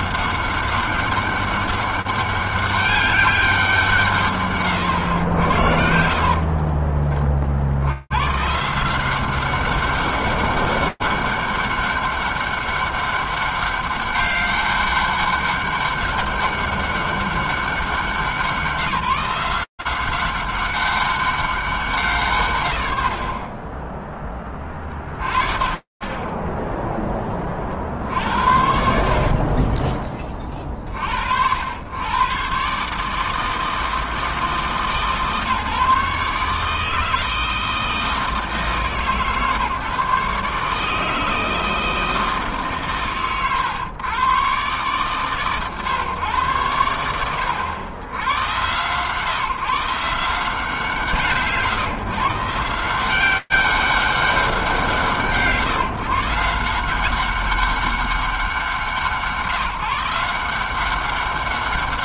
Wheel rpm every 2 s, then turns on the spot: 180, 200, 160, 20, 150, 200, 200, 200, 200, 160, 200, 100, 20, 10, 80, 50, 140, 150, 150, 140, 150, 100, 100, 80, 110, 160, 160, 170, 170, 160, 180.
6-8